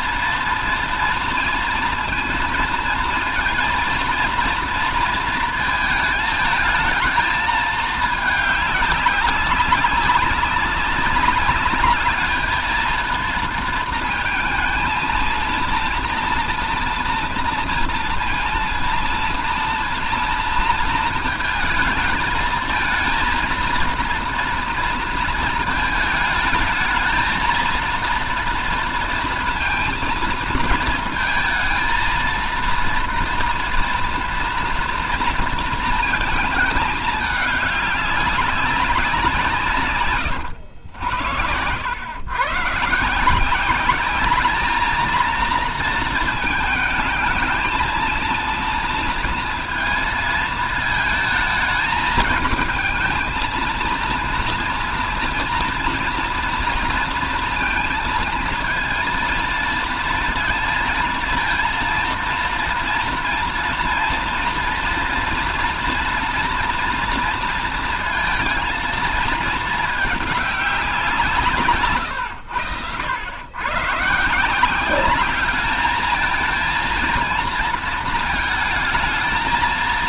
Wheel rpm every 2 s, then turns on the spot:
230, 230, 230, 220, 210, 190, 220, 230, 230, 230, 230, 220, 230, 220, 230, 230, 230, 230, 230, 200, 100, 120, 210, 220, 230, 220, 220, 230, 230, 230, 230, 230, 230, 230, 220, 200, 90, 170, 220, 220.
none